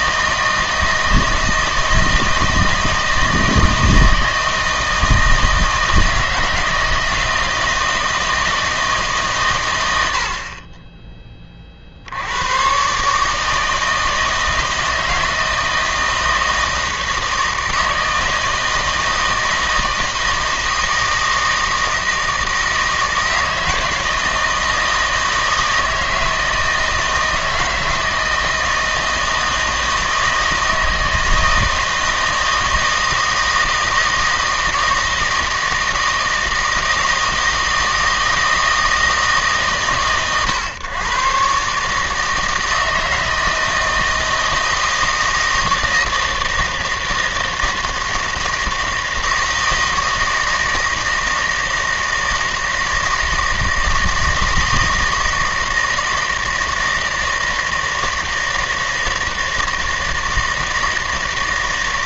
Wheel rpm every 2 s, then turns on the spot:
160, 160, 160, 160, 160, 20, 120, 160, 160, 160, 160, 160, 160, 160, 160, 160, 160, 160, 160, 160, 120, 160, 160, 160, 160, 160, 160, 160, 160, 160, 160.
none